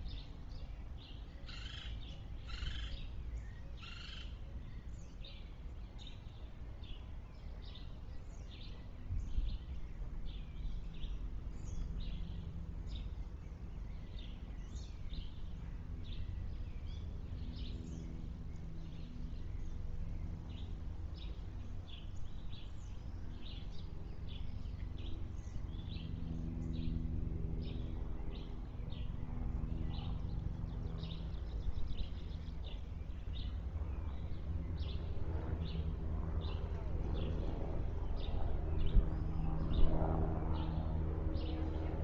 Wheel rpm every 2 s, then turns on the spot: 0, 0, 0, 0, 0, 0, 0, 0, 0, 0, 0, 0, 0, 0, 0, 0, 0, 0, 0, 0, 0.
none